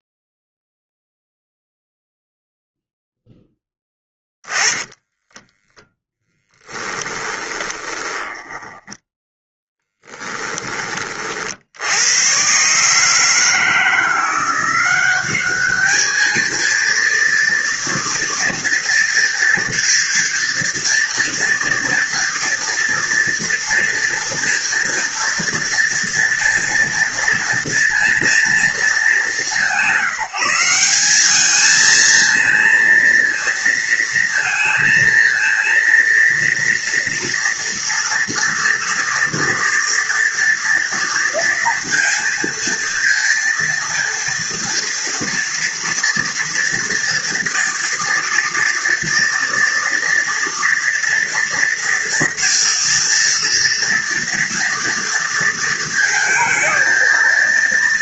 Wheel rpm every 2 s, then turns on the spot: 0, 0, 10, 10, 10, 40, 150, 200, 230, 230, 230, 230, 230, 230, 200, 200, 220, 230, 230, 230, 230, 230, 230, 230, 230, 230, 230, 230, 230.
4-10